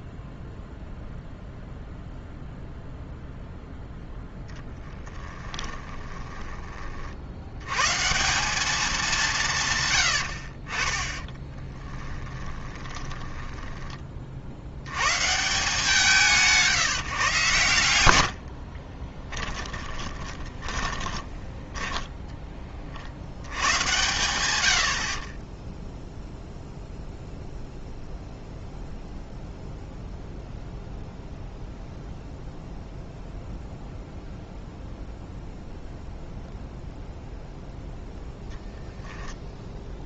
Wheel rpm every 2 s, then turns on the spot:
0, 0, 10, 30, 200, 40, 20, 80, 160, 50, 10, 30, 90, 0, 0, 0, 0, 0, 0, 0.
4-6 12-14 18-22